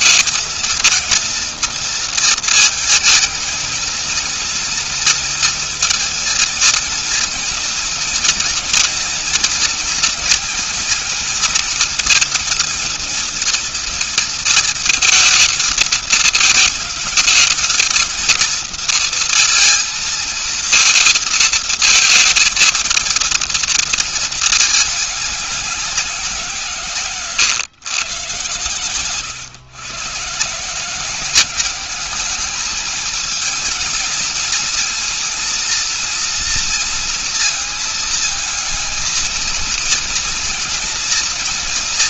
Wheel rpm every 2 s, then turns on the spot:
230, 230, 230, 230, 230, 240, 230, 230, 220, 230, 230, 230, 220, 170, 110, 140, 210, 230, 230, 220, 230.
none